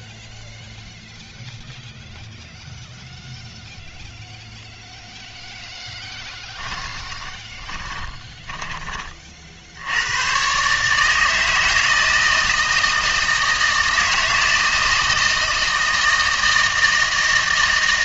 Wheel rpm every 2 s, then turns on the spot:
0, 0, 0, 20, 20, 140, 160, 160, 160.
6-8